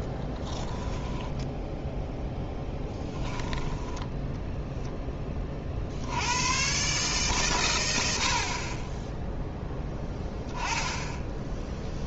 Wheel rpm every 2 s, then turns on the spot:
30, 0, 0, 100, 50, 10.
0-2